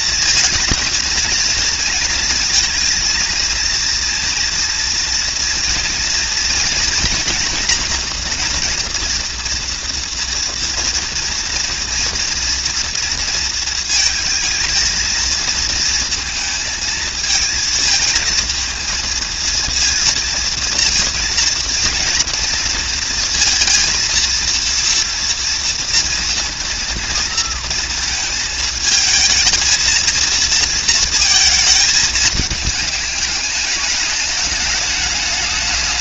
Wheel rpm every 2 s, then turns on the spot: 230, 230, 230, 230, 240, 230, 230, 220, 220, 230, 230, 230, 230, 230, 220, 230, 210, 200.
none